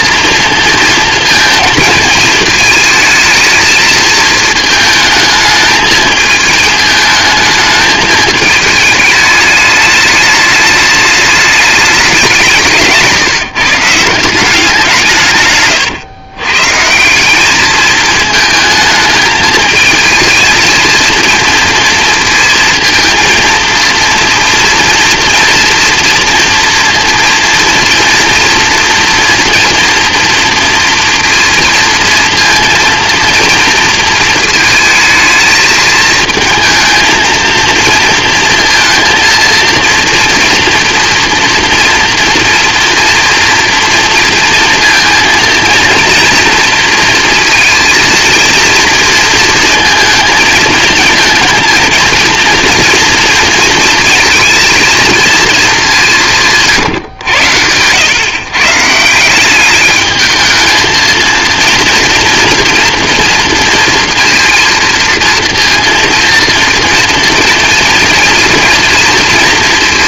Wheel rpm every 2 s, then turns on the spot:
230, 220, 220, 220, 210, 210, 160, 180, 150, 220, 230, 230, 230, 230, 230, 230, 230, 220, 220, 230, 230, 240, 230, 230, 230, 220, 230, 230, 140, 140, 220, 230, 230, 230, 240.
none